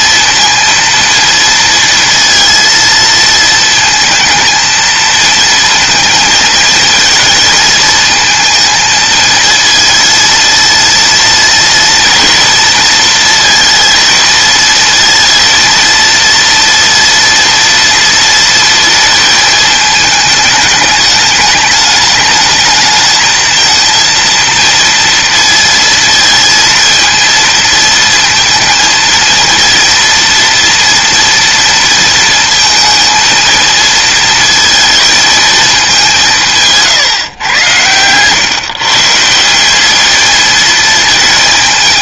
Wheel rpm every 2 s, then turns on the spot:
230, 230, 230, 220, 230, 230, 230, 220, 230, 230, 210, 210, 230, 230, 230, 230, 230, 220, 160, 140, 220.
none